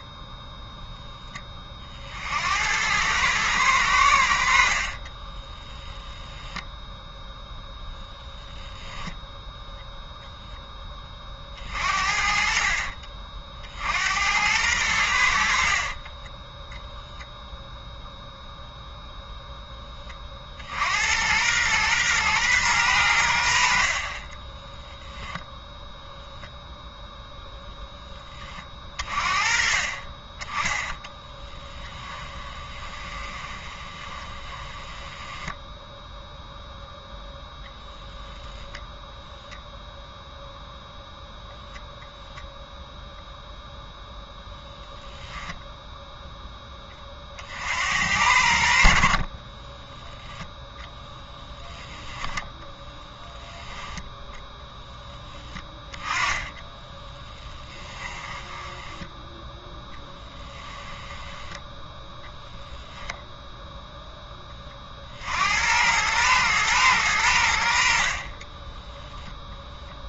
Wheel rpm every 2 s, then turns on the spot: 0, 60, 80, 10, 20, 0, 50, 80, 20, 0, 30, 120, 30, 0, 10, 30, 10, 20, 0, 10, 0, 0, 0, 0, 70, 10, 10, 0, 10, 10, 10, 0, 10, 110, 50.
6-8 32-36 56-62 68-70